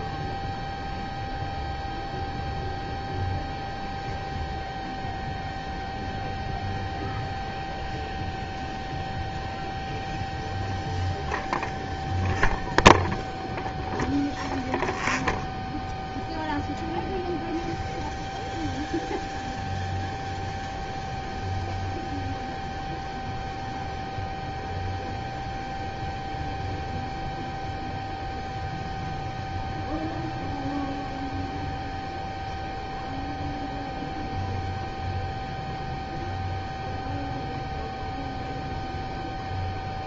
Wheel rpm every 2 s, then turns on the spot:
0, 0, 0, 0, 0, 0, 0, 0, 0, 0, 0, 0, 0, 0, 0, 0, 0, 0, 0, 0.
none